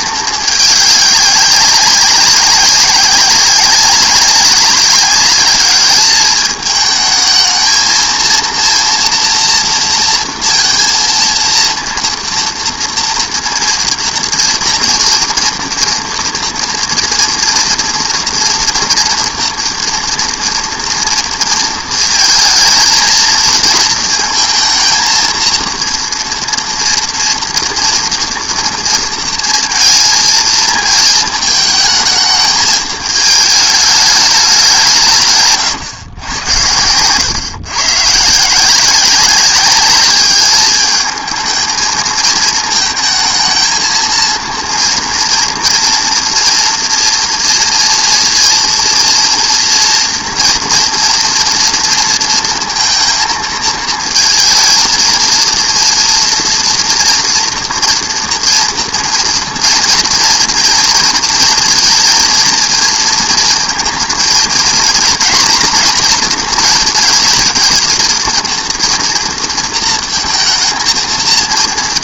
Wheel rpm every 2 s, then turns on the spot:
210, 200, 190, 210, 240, 230, 230, 230, 230, 230, 240, 220, 220, 230, 230, 220, 220, 200, 90, 170, 210, 220, 230, 240, 240, 240, 230, 220, 240, 230, 230, 230, 230, 230, 230, 230.
none